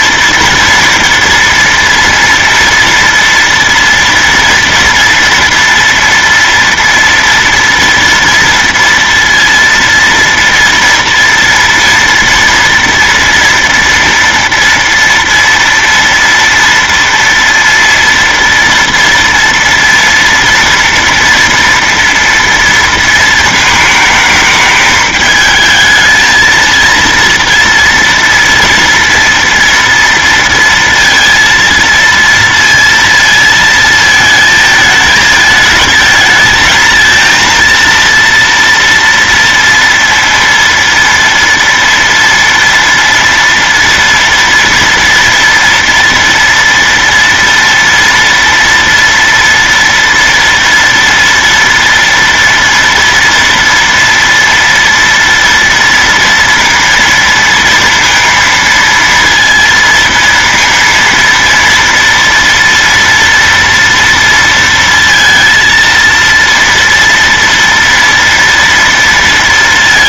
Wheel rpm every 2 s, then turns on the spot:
230, 240, 230, 230, 230, 230, 240, 230, 230, 230, 230, 230, 210, 220, 230, 230, 230, 220, 220, 230, 230, 230, 240, 230, 230, 230, 230, 230, 230, 230, 230, 230, 230, 230, 230.
none